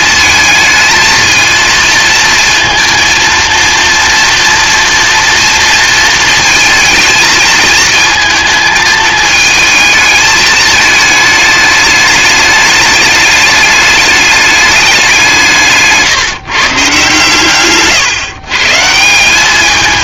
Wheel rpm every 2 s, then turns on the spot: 220, 230, 230, 220, 220, 220, 210, 210, 150, 140.
none